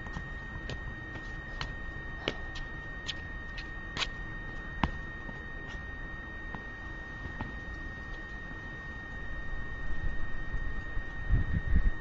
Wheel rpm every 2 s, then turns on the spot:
0, 0, 0, 0, 0, 0.
none